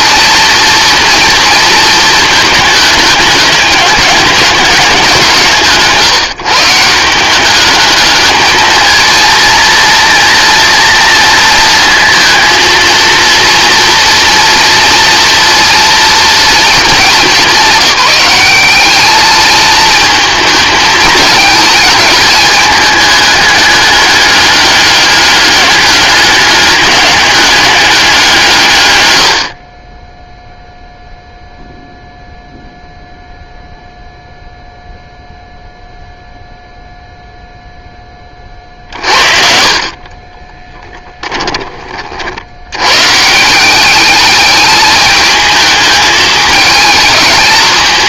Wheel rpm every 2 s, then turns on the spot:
230, 210, 190, 170, 230, 240, 230, 230, 220, 210, 220, 210, 200, 190, 110, 0, 0, 0, 0, 40, 10, 110, 210, 210.
38-42